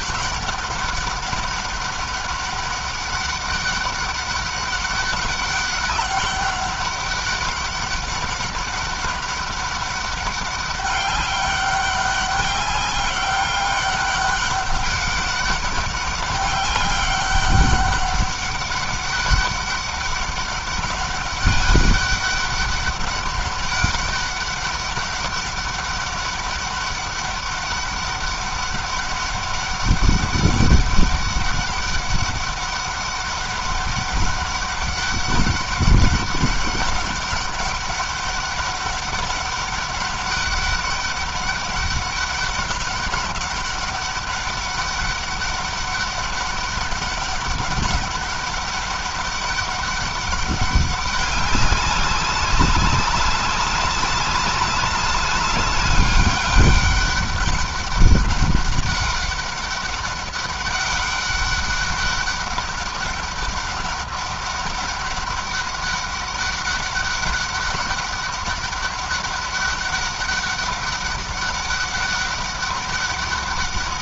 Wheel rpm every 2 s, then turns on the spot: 200, 200, 200, 200, 200, 200, 200, 200, 200, 200, 200, 200, 200, 200, 200, 200, 200, 200, 200, 200, 200, 200, 200, 200, 190, 200, 190, 190, 200, 200, 200, 200, 200, 200, 200, 200, 200.
none